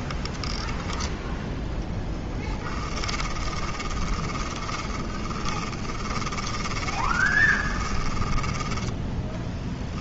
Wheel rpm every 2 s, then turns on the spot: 10, 20, 20, 20, 10.
0-10